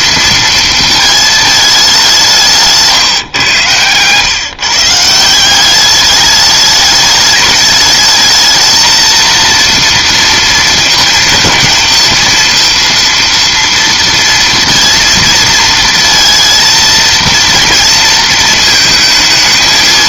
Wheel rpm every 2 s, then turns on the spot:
230, 160, 150, 210, 220, 230, 230, 230, 230, 220.
none